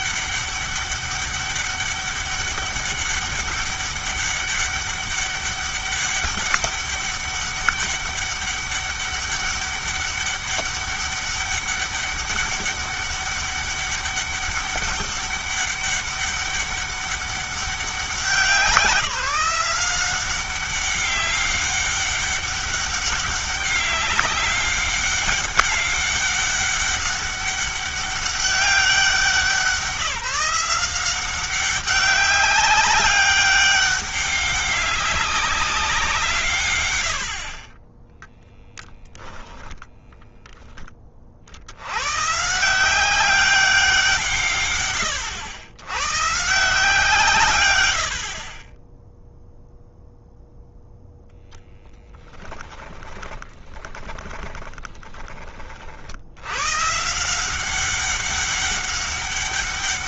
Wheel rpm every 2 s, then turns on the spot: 200, 200, 200, 200, 200, 200, 200, 200, 200, 180, 190, 200, 200, 200, 190, 170, 200, 200, 110, 10, 10, 160, 120, 160, 30, 0, 20, 20, 150, 200.
38-40 52-56